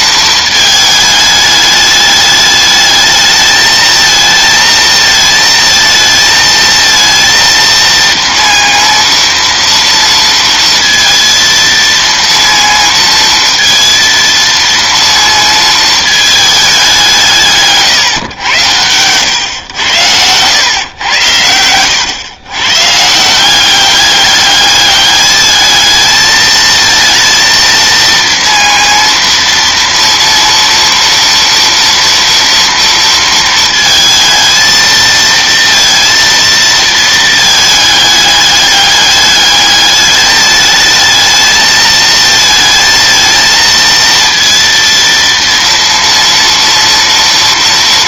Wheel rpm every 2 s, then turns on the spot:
220, 210, 220, 230, 230, 230, 230, 230, 210, 110, 110, 130, 200, 220, 230, 230, 230, 220, 230, 210, 210, 220, 230, 230.
none